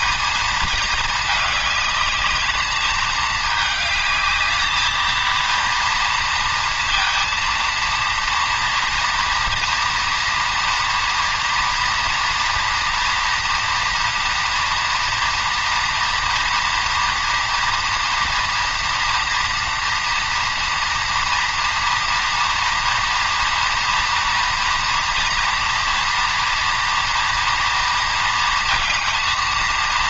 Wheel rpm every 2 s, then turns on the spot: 220, 210, 220, 230, 230, 230, 240, 230, 240, 230, 240, 230, 230, 230, 230.
none